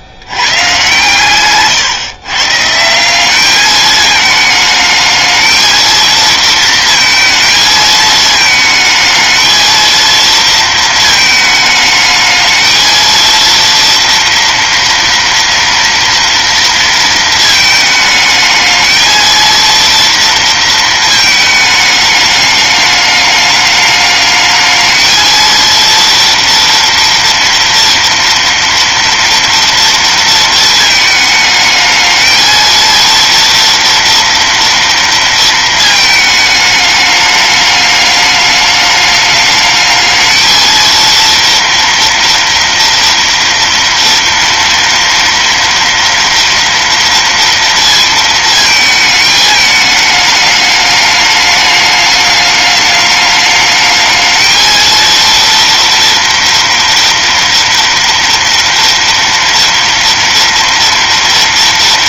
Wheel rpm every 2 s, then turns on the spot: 130, 150, 220, 230, 220, 230, 220, 230, 230, 220, 230, 210, 220, 230, 230, 220, 230, 230, 210, 210, 230, 240, 230, 230, 220, 210, 210, 220, 230, 240, 230.
none